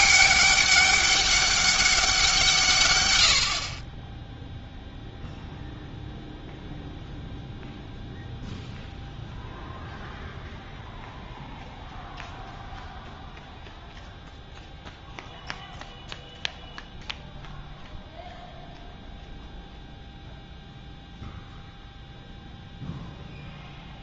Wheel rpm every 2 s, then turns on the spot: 200, 150, 0, 0, 0, 0, 0, 0, 0, 0, 0, 0.
none